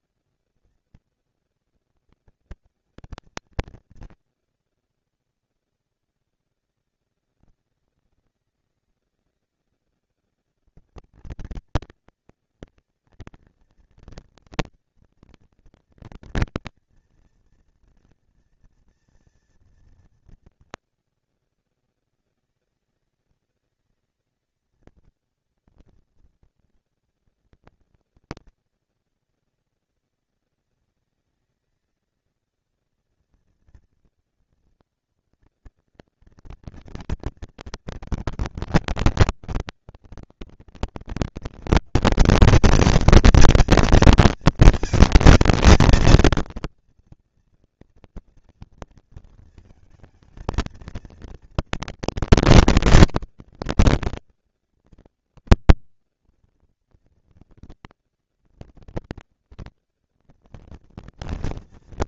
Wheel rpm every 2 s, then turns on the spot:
230, 230, 230, 210, 200, 210, 230, 230, 230, 230, 230, 230, 220, 230, 230, 230, 220, 230, 230, 210, 200, 210, 220, 230, 230, 230, 240, 230, 230, 230, 230.
none